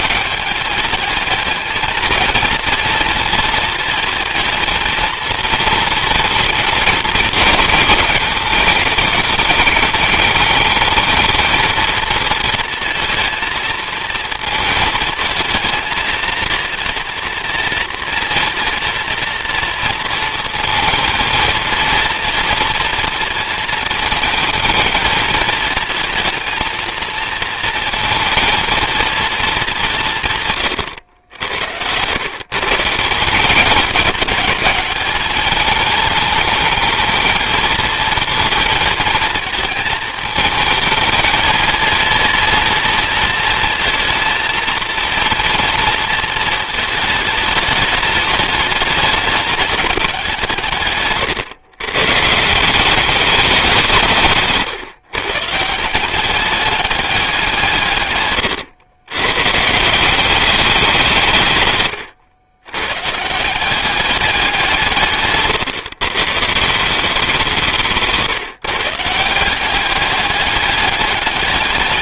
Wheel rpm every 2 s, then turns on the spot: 210, 230, 230, 230, 210, 210, 230, 230, 230, 230, 230, 230, 220, 230, 220, 120, 160, 210, 220, 230, 220, 230, 230, 220, 210, 150, 180, 140, 200, 130, 190, 110, 180, 160, 160, 200.
none